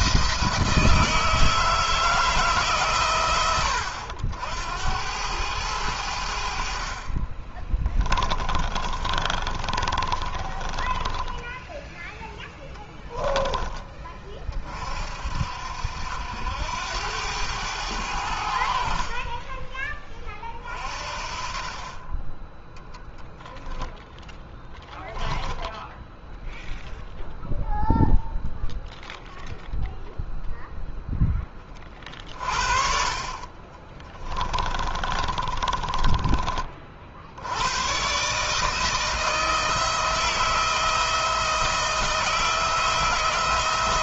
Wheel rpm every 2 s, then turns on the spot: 160, 140, 90, 50, 30, 20, 10, 40, 90, 50, 40, 10, 10, 0, 0, 0, 40, 30, 40, 160, 160, 170.
8-12 24-26 34-36